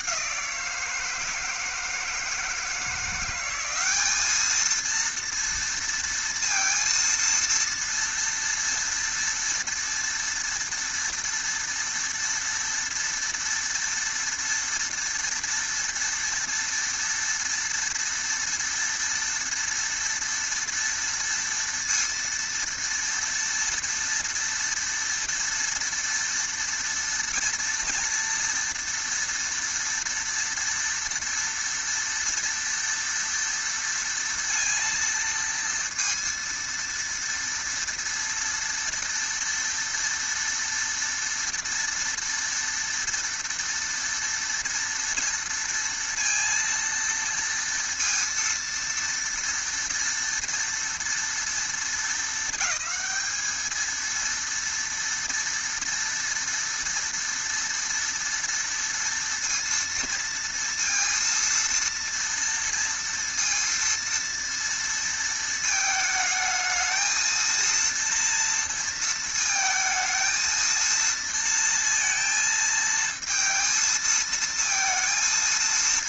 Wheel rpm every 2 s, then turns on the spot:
170, 160, 220, 230, 230, 230, 230, 230, 230, 230, 230, 230, 230, 230, 230, 230, 230, 230, 230, 230, 230, 230, 230, 230, 230, 230, 200, 230, 230, 230, 230, 230, 230, 220, 230, 230, 230, 220.
none